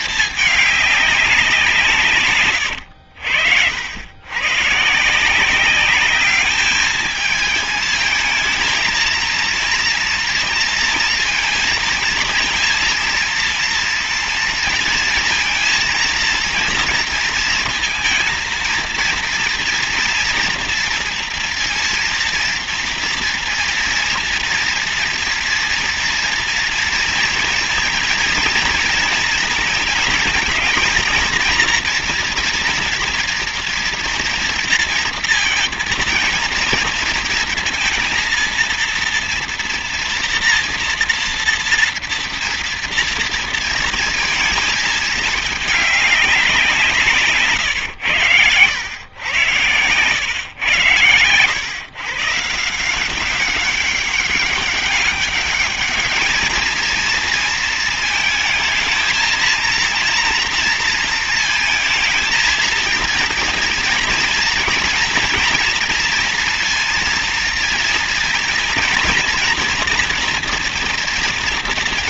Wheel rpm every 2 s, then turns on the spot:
210, 120, 130, 210, 220, 230, 230, 230, 230, 230, 230, 230, 230, 230, 230, 220, 230, 230, 230, 230, 230, 240, 230, 180, 100, 110, 160, 200, 220, 220, 230, 220, 230, 230, 240, 240.
none